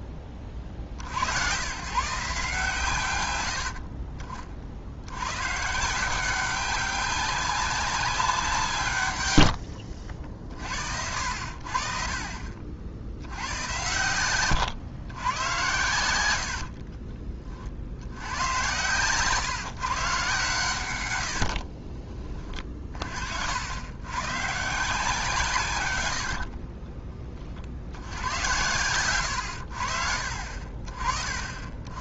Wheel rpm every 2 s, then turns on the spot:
60, 130, 80, 190, 140, 60, 60, 110, 40, 120, 100, 40, 160, 50, 110, 40.
16-18 26-28